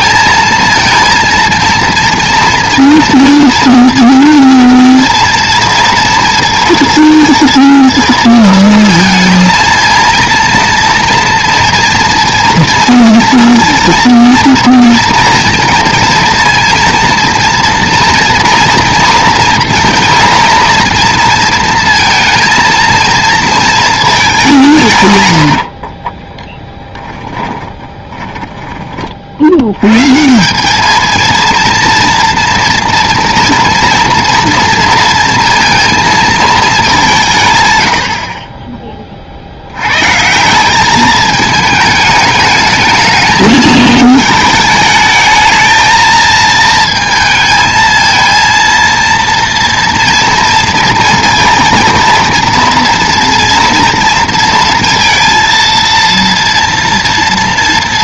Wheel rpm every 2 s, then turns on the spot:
230, 230, 230, 230, 230, 230, 230, 230, 230, 230, 230, 230, 190, 10, 20, 190, 230, 230, 220, 30, 180, 220, 220, 220, 230, 230, 230, 230, 230.
26-30